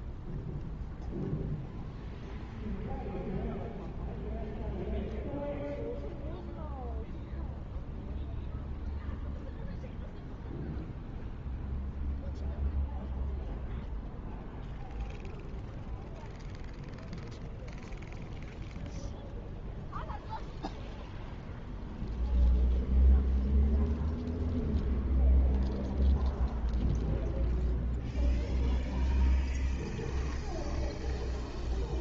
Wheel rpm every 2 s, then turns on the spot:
0, 0, 0, 0, 0, 0, 0, 0, 0, 0, 0, 0, 0, 0, 0, 0.
none